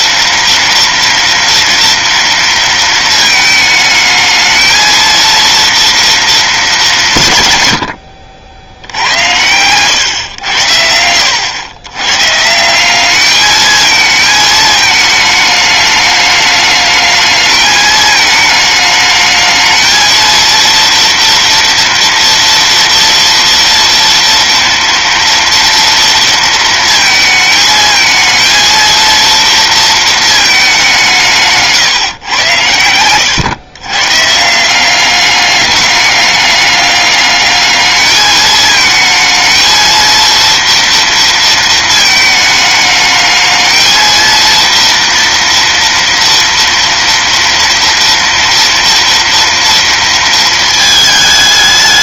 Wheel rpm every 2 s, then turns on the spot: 230, 230, 220, 210, 70, 90, 160, 220, 210, 220, 230, 230, 230, 230, 230, 200, 100, 170, 200, 220, 230, 220, 230, 230, 230, 230.
none